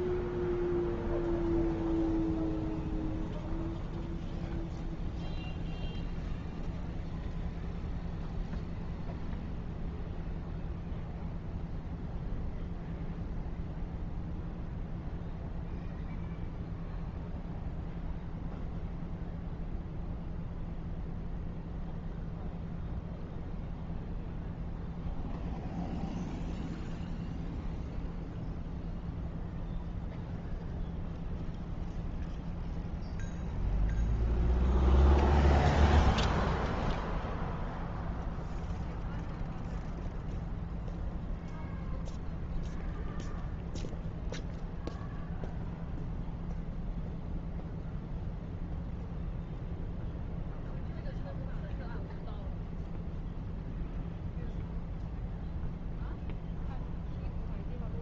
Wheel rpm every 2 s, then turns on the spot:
0, 0, 0, 0, 0, 0, 0, 0, 0, 0, 0, 0, 0, 0, 0, 0, 0, 0, 0, 0, 0, 0, 0, 0, 0, 0, 0, 0, 0.
none